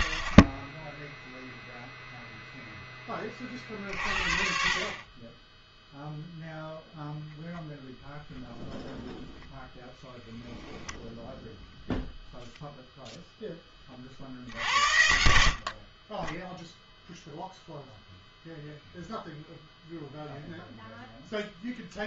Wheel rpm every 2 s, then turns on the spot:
10, 0, 40, 0, 0, 10, 0, 90, 0, 0, 0.
none